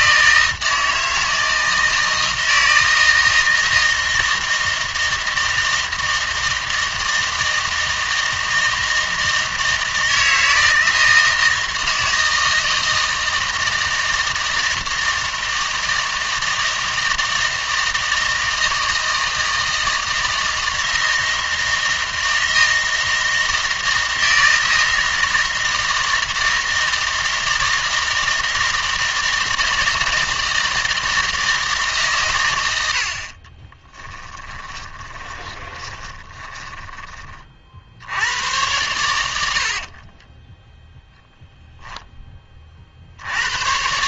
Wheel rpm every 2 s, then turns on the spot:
160, 160, 160, 160, 160, 160, 160, 160, 160, 160, 160, 160, 160, 160, 160, 160, 110, 20, 20, 90, 10, 30.
34-38 40-42